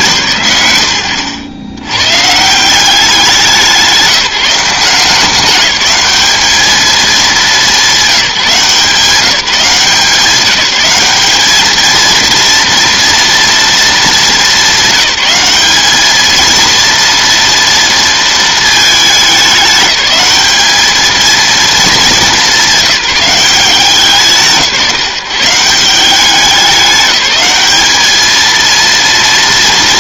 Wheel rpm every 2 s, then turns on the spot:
110, 180, 180, 220, 170, 190, 230, 210, 230, 220, 210, 200, 160, 200, 230.
none